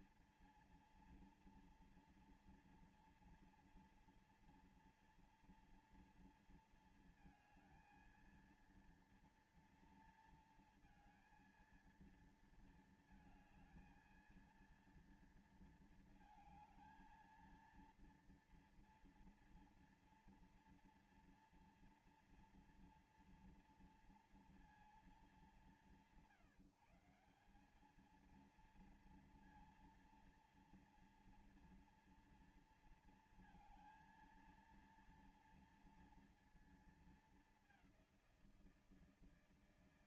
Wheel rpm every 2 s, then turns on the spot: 230, 230, 230, 240, 230, 230, 230, 230, 220, 230, 230, 230, 230, 190, 210, 230, 230, 230, 230, 190.
none